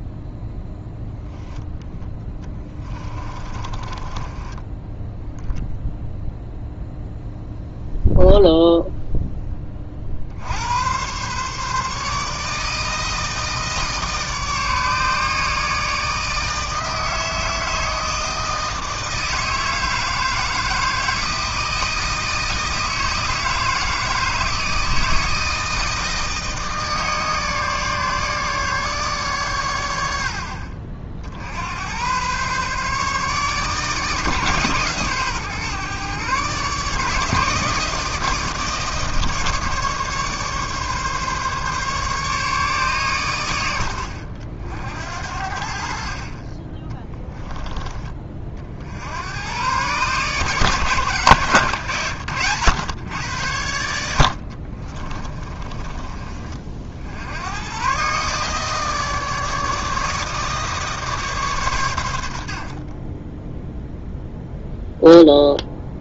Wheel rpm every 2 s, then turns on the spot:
0, 20, 20, 0, 0, 110, 160, 150, 160, 160, 160, 160, 160, 160, 140, 50, 140, 140, 150, 160, 140, 130, 60, 20, 60, 140, 110, 30, 60, 150, 150, 40, 0.
2-4 46-48 54-56